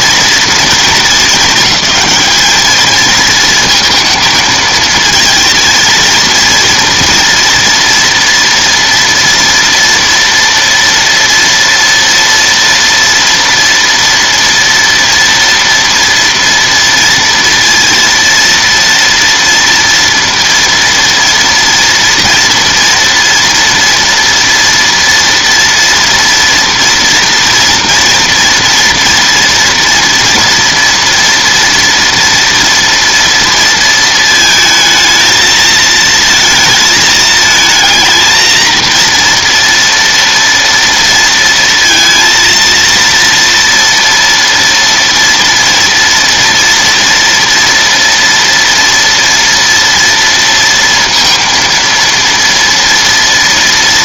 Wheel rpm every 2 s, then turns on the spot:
230, 210, 220, 230, 230, 230, 240, 240, 240, 230, 230, 230, 230, 230, 240, 230, 230, 220, 220, 220, 230, 230, 230, 230, 230, 230, 230.
none